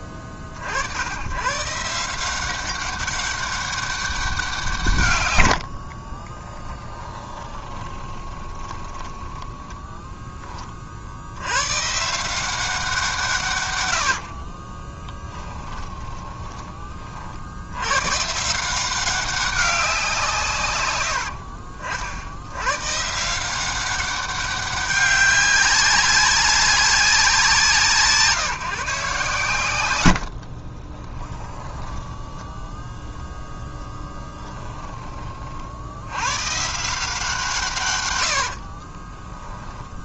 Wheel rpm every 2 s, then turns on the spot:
80, 190, 170, 30, 20, 30, 180, 30, 20, 160, 160, 110, 200, 190, 160, 50, 10, 10, 140, 50.
6-10 14-16 30-32 34-36 38-40